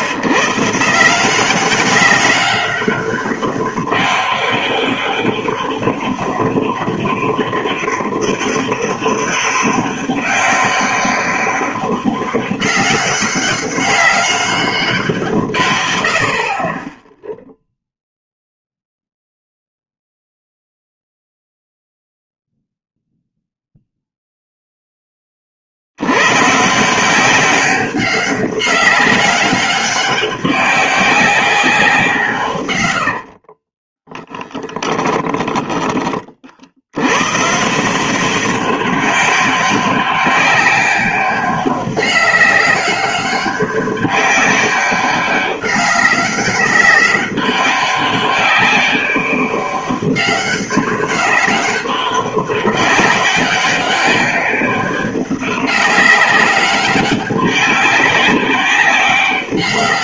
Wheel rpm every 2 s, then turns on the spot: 120, 200, 200, 200, 200, 200, 200, 200, 40, 0, 0, 0, 0, 140, 200, 190, 130, 10, 60, 190, 200, 200, 200, 200, 200, 200, 200, 190, 190, 200.
34-36